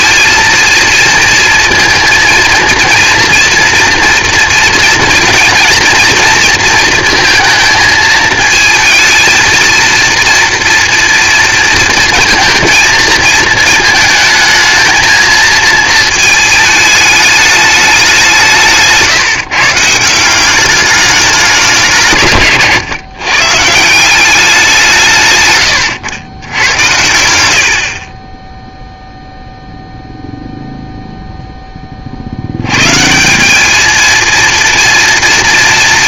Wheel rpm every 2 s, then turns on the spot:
230, 230, 230, 230, 220, 230, 230, 220, 220, 170, 190, 140, 180, 100, 10, 0, 90, 230.
none